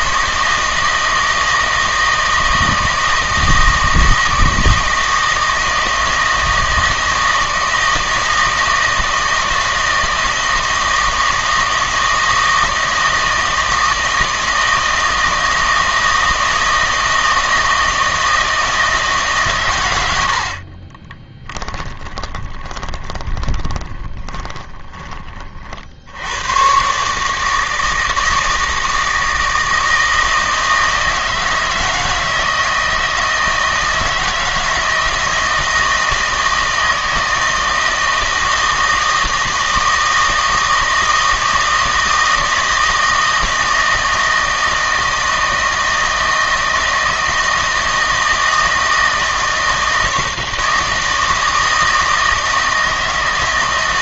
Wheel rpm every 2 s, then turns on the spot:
160, 160, 160, 160, 160, 160, 160, 160, 160, 160, 60, 20, 20, 120, 160, 160, 160, 160, 160, 160, 160, 160, 160, 160, 160, 160, 160.
20-26